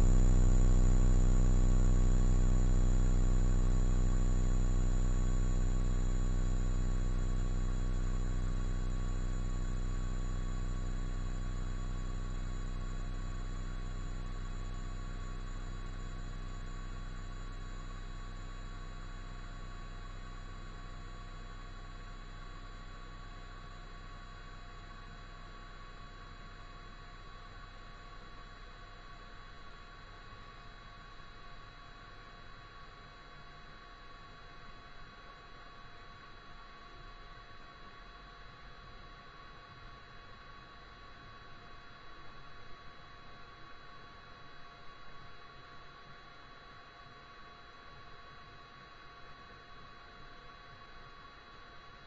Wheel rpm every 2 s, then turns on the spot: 0, 0, 0, 0, 0, 0, 0, 0, 0, 0, 0, 0, 0, 0, 0, 0, 0, 0, 0, 0, 0, 0, 0, 0, 0, 0.
none